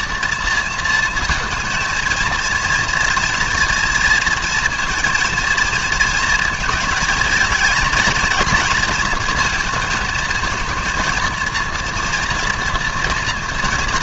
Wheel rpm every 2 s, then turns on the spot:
230, 230, 230, 220, 230, 230, 240.
none